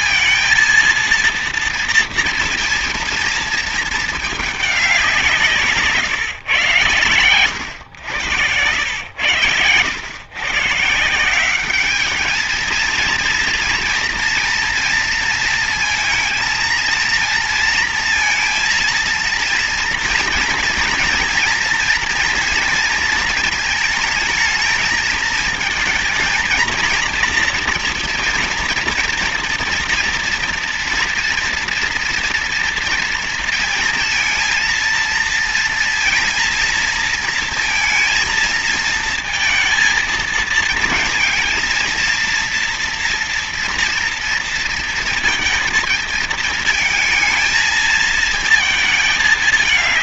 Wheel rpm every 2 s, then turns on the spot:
230, 230, 210, 110, 90, 120, 210, 230, 220, 230, 240, 230, 220, 230, 230, 240, 240, 230, 230, 230, 230, 230, 230, 220, 220.
none